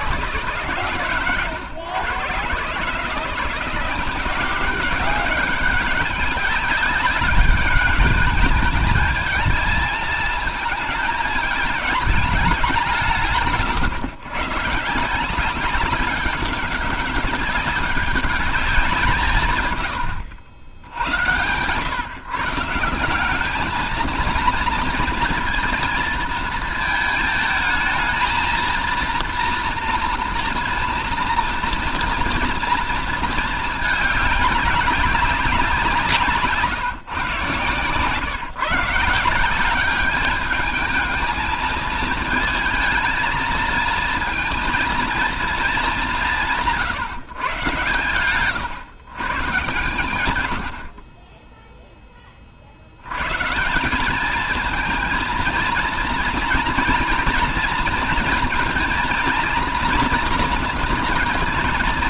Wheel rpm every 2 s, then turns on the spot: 140, 140, 190, 200, 210, 220, 190, 130, 190, 190, 90, 160, 230, 220, 230, 230, 230, 200, 160, 150, 210, 220, 230, 180, 120, 80, 50, 220, 240, 230, 230.
none